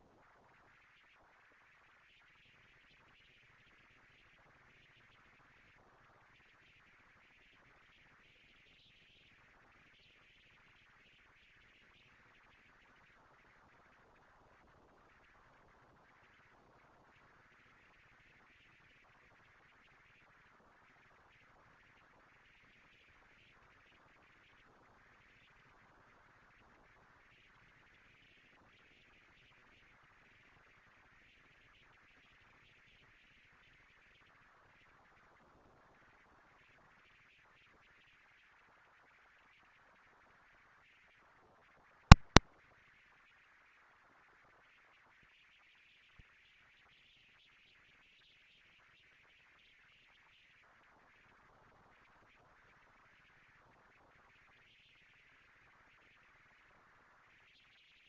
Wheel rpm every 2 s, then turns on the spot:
230, 220, 230, 230, 230, 230, 220, 220, 190, 160, 120, 150, 220, 230, 230, 230, 230, 230, 230, 230, 230, 230, 230, 230, 230, 230, 220, 220, 230.
none